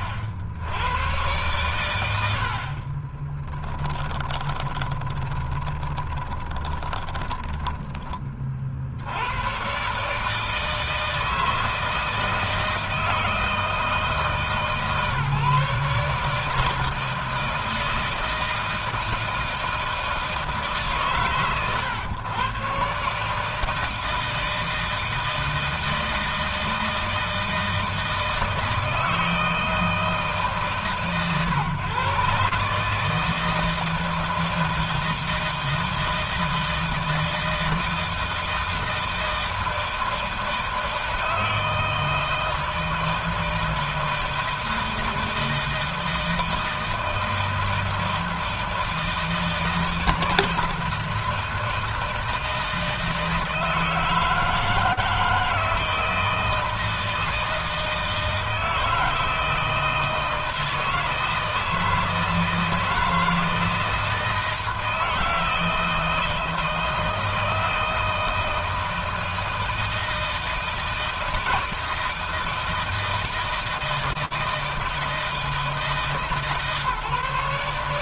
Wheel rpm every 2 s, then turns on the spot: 100, 50, 20, 20, 50, 160, 160, 140, 160, 160, 140, 140, 160, 160, 160, 140, 150, 160, 160, 160, 160, 160, 160, 160, 160, 160, 160, 160, 160, 160, 160, 160, 160, 160, 160, 160, 160, 160, 150.
2-8